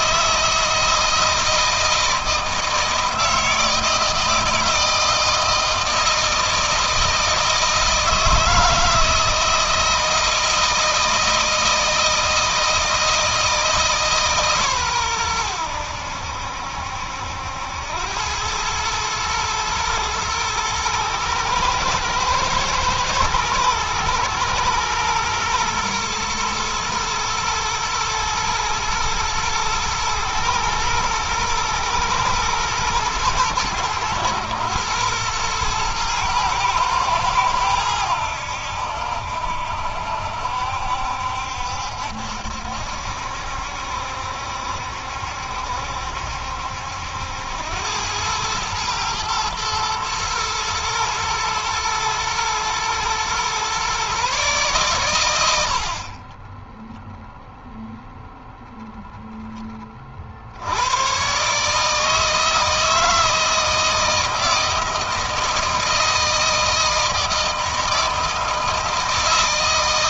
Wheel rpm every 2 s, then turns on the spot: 160, 160, 160, 160, 160, 160, 160, 130, 70, 110, 110, 120, 110, 120, 110, 110, 110, 110, 110, 80, 70, 70, 70, 80, 110, 110, 120, 120, 10, 0, 80, 160, 160, 160, 160.
none